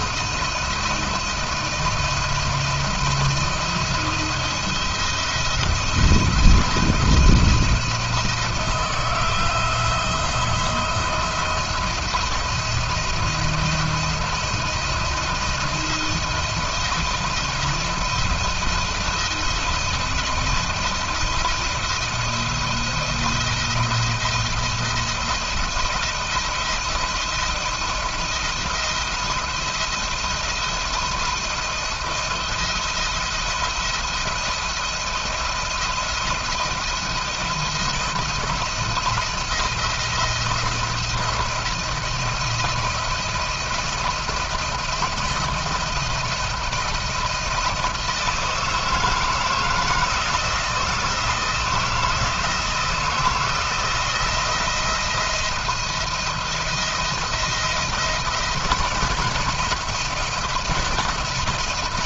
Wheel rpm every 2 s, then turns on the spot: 170, 170, 170, 170, 160, 170, 170, 170, 170, 170, 170, 170, 170, 170, 170, 170, 170, 170, 170, 170, 170, 170, 170, 170, 160, 170, 160, 170, 170, 170, 170.
none